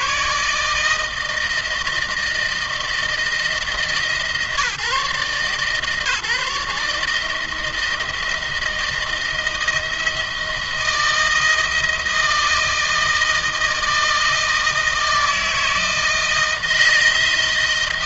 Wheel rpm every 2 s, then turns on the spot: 160, 160, 150, 160, 170, 160, 160, 160, 160.
none